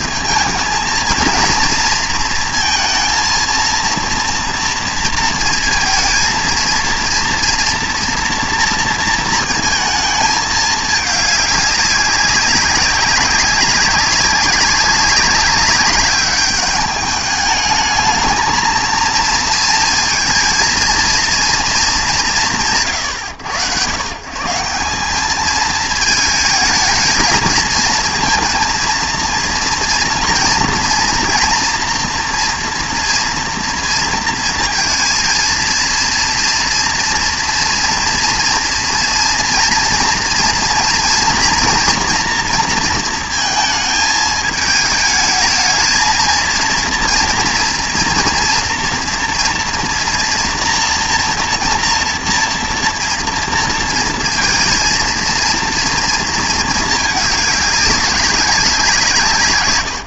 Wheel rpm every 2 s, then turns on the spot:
220, 230, 230, 230, 230, 210, 190, 200, 210, 220, 230, 110, 170, 220, 230, 230, 230, 230, 230, 230, 230, 230, 220, 230, 230, 230, 240, 230, 220, 190.
none